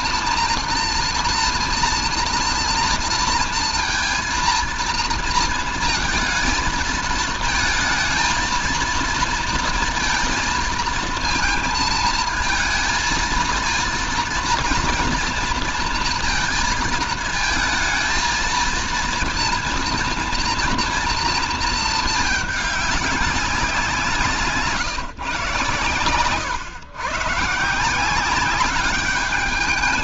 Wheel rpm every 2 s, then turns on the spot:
230, 230, 230, 220, 230, 230, 230, 230, 230, 230, 230, 200, 160, 120, 200.
none